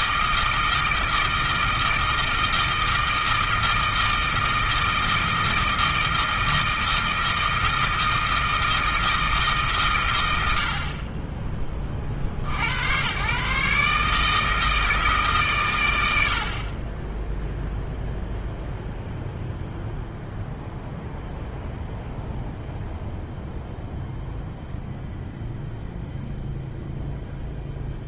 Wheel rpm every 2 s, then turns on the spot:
160, 160, 160, 160, 160, 50, 110, 160, 30, 0, 0, 0, 0, 0.
none